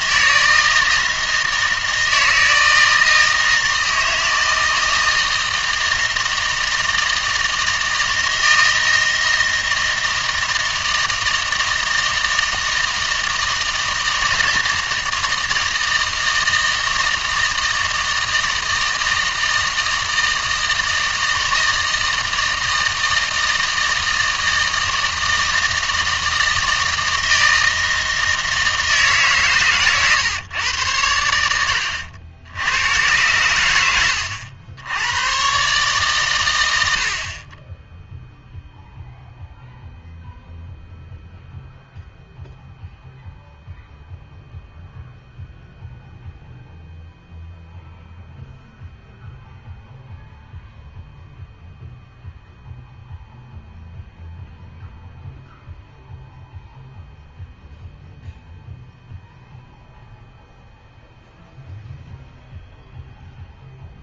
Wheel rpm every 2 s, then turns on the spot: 160, 160, 160, 160, 160, 160, 160, 160, 160, 160, 160, 160, 160, 160, 160, 110, 110, 80, 90, 0, 0, 0, 0, 0, 0, 0, 0, 0, 0, 0, 0, 0.
none